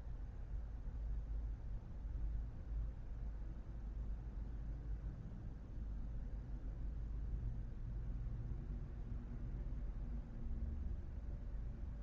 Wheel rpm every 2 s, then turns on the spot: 0, 0, 0, 0, 0, 0.
none